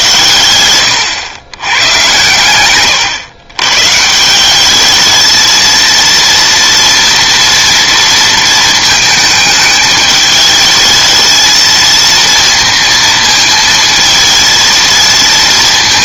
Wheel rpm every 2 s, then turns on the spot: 110, 130, 200, 230, 230, 220, 230, 220.
none